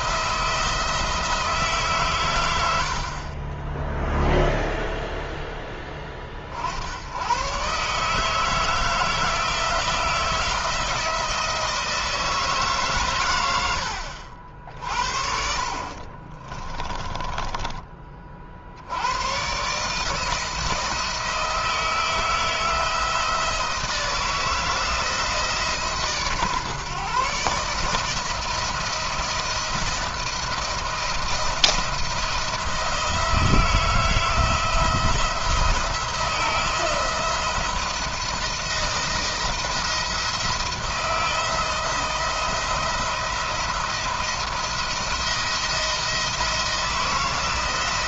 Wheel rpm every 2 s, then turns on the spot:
170, 70, 0, 70, 160, 160, 140, 60, 20, 60, 160, 160, 160, 140, 170, 170, 170, 170, 160, 170, 170, 170, 170, 170.
16-18